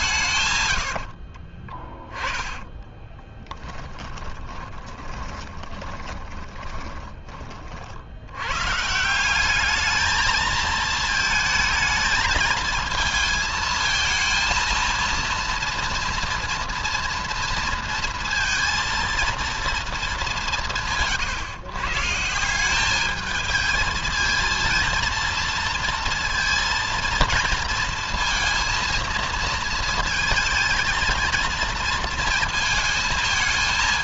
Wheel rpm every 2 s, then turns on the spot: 90, 20, 20, 20, 140, 220, 220, 230, 230, 230, 160, 200, 230, 230, 230, 220, 230.
0-6